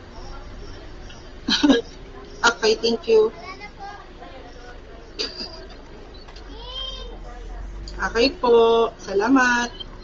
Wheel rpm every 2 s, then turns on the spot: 0, 0, 0, 0, 0.
none